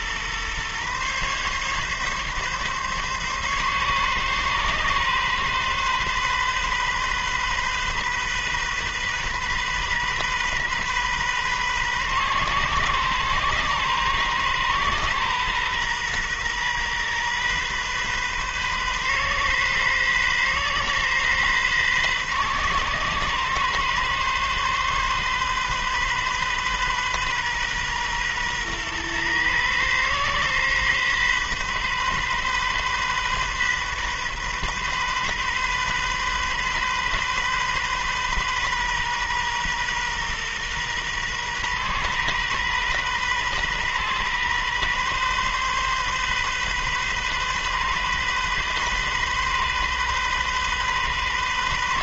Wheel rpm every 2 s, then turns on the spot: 130, 140, 130, 130, 130, 130, 130, 130, 130, 130, 130, 130, 130, 130, 120, 130, 130, 130, 130, 130, 120, 130, 130, 130, 130, 130.
none